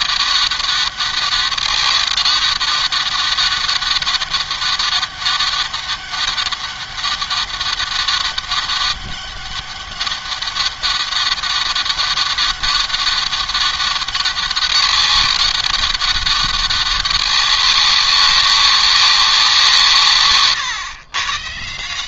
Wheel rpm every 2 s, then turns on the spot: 200, 200, 200, 200, 190, 200, 200, 200, 200, 200, 120.
none